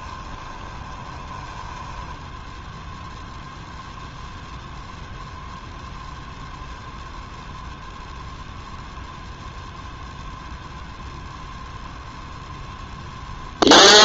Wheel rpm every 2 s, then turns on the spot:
20, 0, 0, 0, 0, 0, 0.
0-2